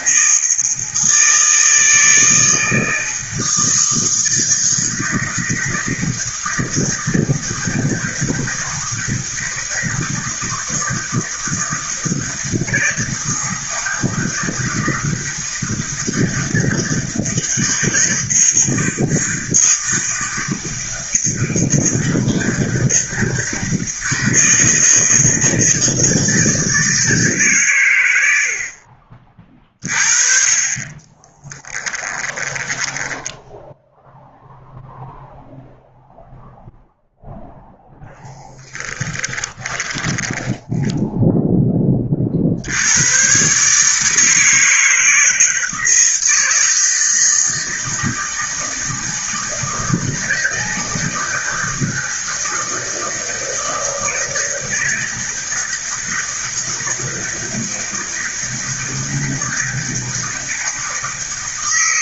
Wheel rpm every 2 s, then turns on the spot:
160, 160, 160, 160, 160, 160, 160, 160, 160, 160, 160, 160, 160, 160, 40, 30, 10, 0, 0, 10, 0, 100, 160, 160, 160, 160, 160, 160, 160, 160, 160.
30-34 38-40